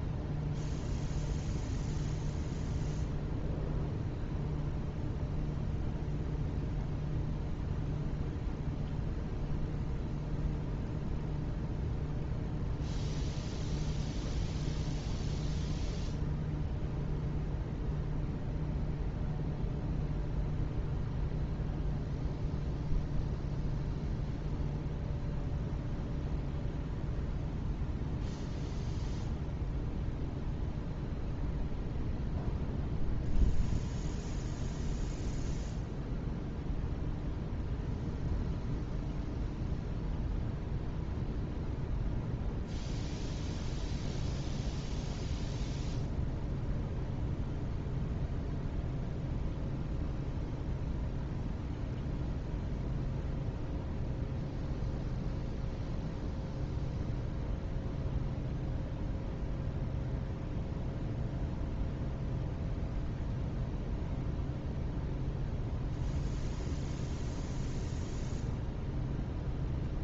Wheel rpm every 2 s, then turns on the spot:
0, 0, 0, 0, 0, 0, 0, 0, 0, 0, 0, 0, 0, 0, 0, 0, 0, 0, 0, 0, 0, 0, 0, 0, 0, 0, 0, 0, 0, 0, 0, 0, 0, 0, 0.
none